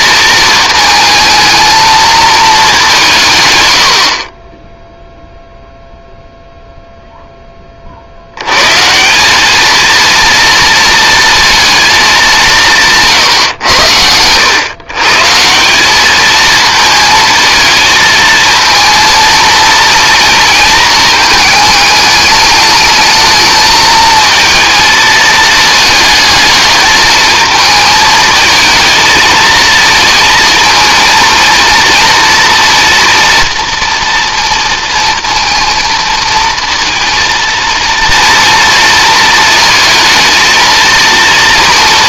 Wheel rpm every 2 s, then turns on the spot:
220, 190, 0, 0, 140, 230, 160, 130, 220, 230, 230, 210, 220, 220, 220, 230, 230, 230, 230, 230, 230.
none